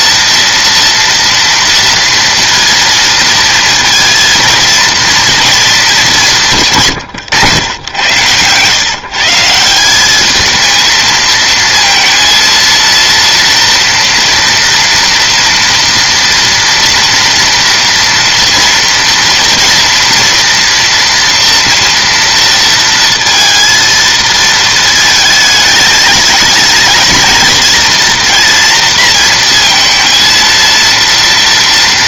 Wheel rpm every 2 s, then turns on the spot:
230, 230, 220, 140, 140, 220, 230, 230, 230, 230, 230, 230, 220, 220, 230, 230.
none